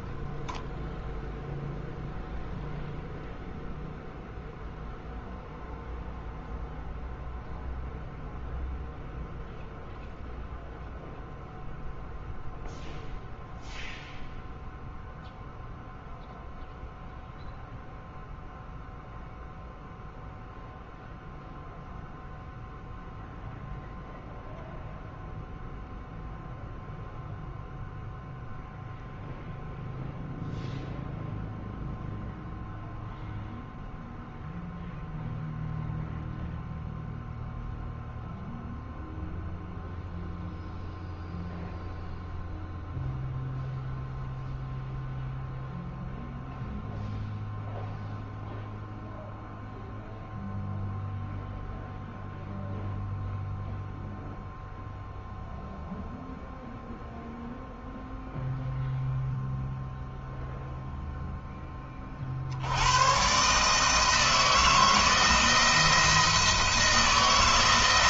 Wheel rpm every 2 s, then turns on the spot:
30, 0, 0, 0, 0, 0, 0, 0, 0, 0, 0, 0, 0, 0, 0, 0, 0, 0, 0, 0, 0, 0, 0, 0, 0, 0, 0, 0, 0, 0, 0, 70, 170, 170.
none